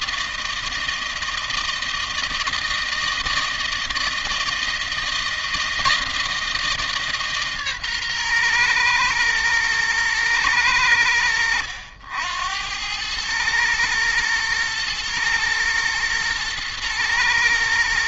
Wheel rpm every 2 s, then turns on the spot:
160, 160, 160, 150, 120, 100, 100, 110, 120.
none